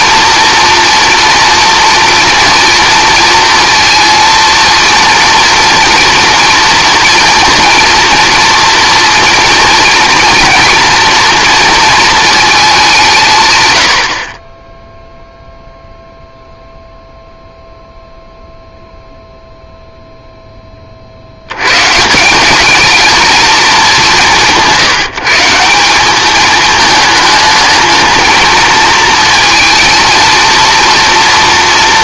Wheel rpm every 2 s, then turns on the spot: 230, 230, 230, 230, 230, 230, 220, 30, 0, 0, 20, 200, 170, 220, 220, 230.
none